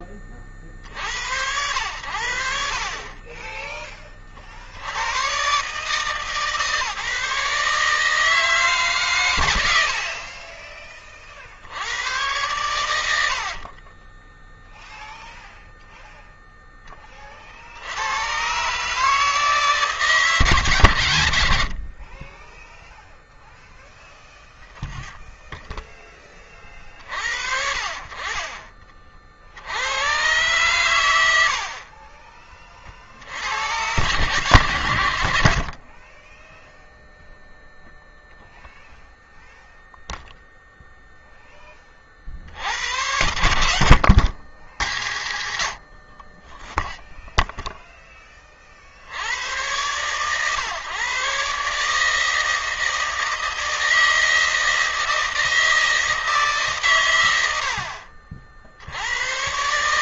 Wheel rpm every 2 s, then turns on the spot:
50, 70, 60, 150, 150, 40, 100, 0, 10, 130, 130, 10, 0, 40, 40, 120, 30, 110, 0, 0, 0, 70, 80, 20, 30, 130, 160, 160, 150, 70.
12-14